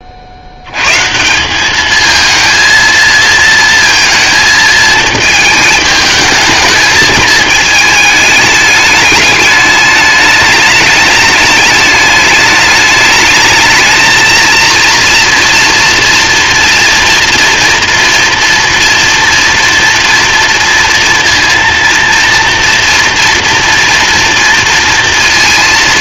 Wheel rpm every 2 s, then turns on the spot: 20, 200, 220, 220, 210, 210, 210, 220, 230, 230, 230, 230, 230.
none